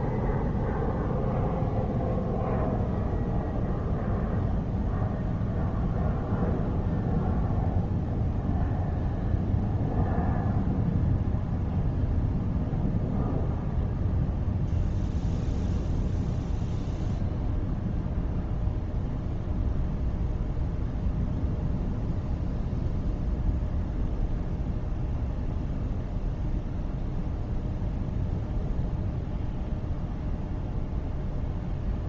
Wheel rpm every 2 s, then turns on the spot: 0, 0, 0, 0, 0, 0, 0, 0, 0, 0, 0, 0, 0, 0, 0, 0.
none